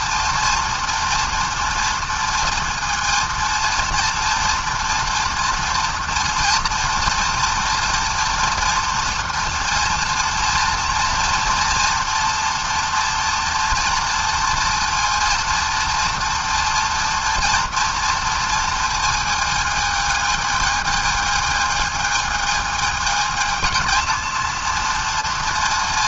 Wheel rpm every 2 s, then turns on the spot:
230, 230, 230, 230, 230, 230, 240, 230, 230, 230, 220, 220, 230.
none